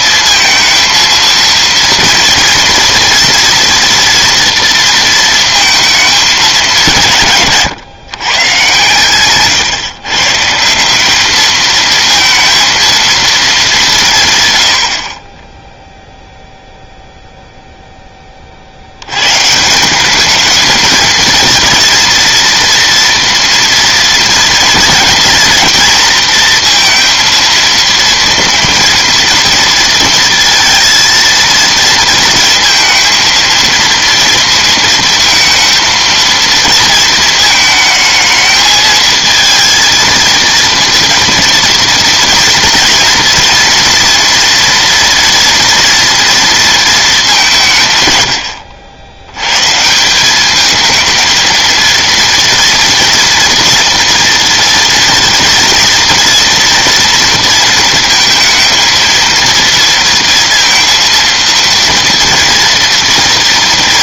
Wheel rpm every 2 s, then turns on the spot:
230, 230, 230, 180, 130, 170, 230, 90, 0, 50, 220, 230, 230, 230, 230, 230, 230, 230, 230, 220, 230, 230, 230, 230, 80, 220, 230, 230, 230, 230, 230, 230.
none